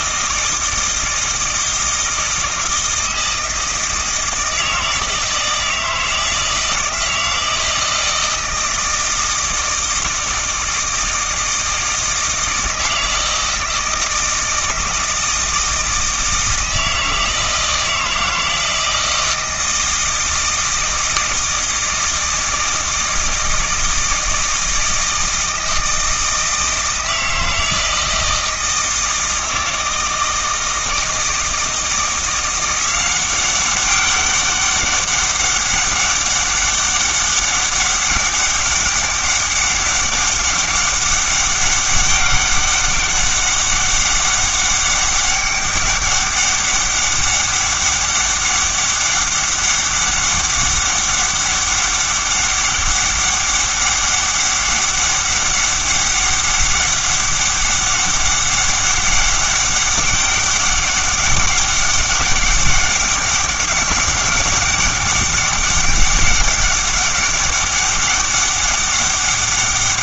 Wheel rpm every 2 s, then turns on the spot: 160, 160, 160, 160, 160, 160, 160, 160, 160, 160, 160, 160, 160, 160, 160, 160, 180, 200, 200, 200, 200, 200, 200, 200, 200, 200, 200, 200, 200, 200, 200, 200, 200, 200, 200.
none